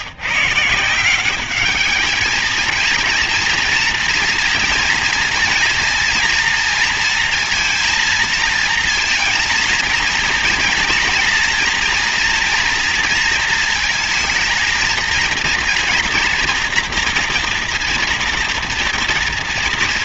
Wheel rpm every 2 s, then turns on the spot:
150, 220, 230, 230, 230, 240, 230, 220, 230, 230.
none